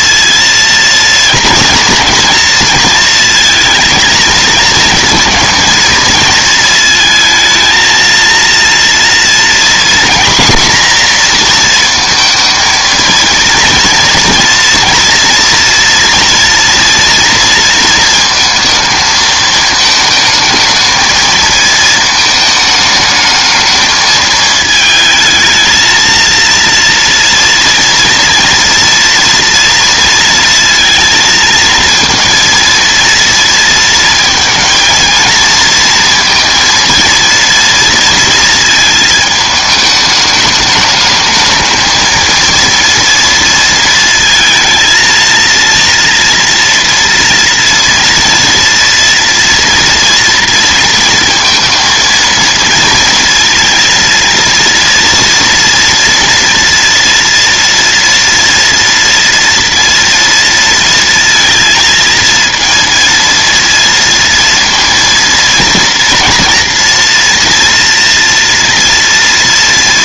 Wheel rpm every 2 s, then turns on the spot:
230, 230, 230, 230, 230, 240, 230, 230, 230, 220, 220, 220, 220, 230, 230, 230, 230, 230, 230, 230, 210, 230, 230, 230, 230, 230, 230, 230, 230, 230, 230, 230, 230, 230, 230.
none